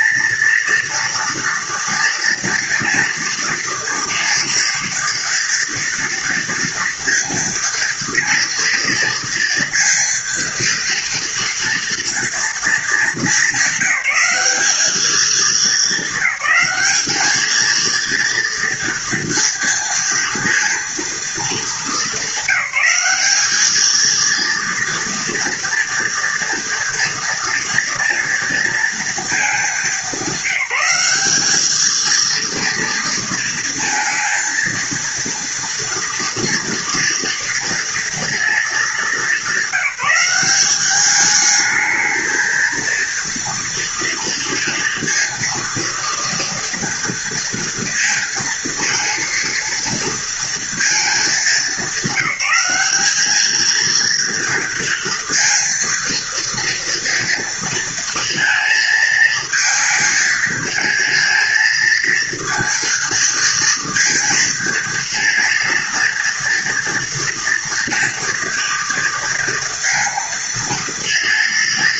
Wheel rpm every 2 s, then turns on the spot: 230, 230, 230, 230, 230, 230, 220, 210, 210, 230, 230, 210, 230, 230, 230, 200, 230, 230, 230, 210, 200, 230, 230, 230, 230, 220, 200, 230, 230, 220, 220, 230, 230, 230, 230, 230.
none